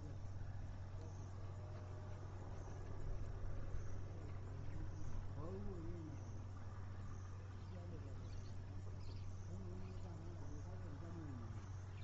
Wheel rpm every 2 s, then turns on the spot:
0, 0, 0, 0, 0, 0.
none